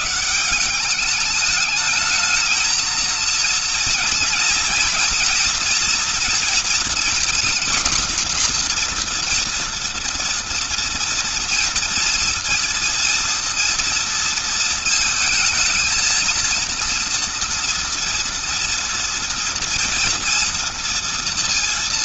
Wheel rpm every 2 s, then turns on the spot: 190, 220, 240, 240, 240, 230, 230, 220, 230, 230, 230.
none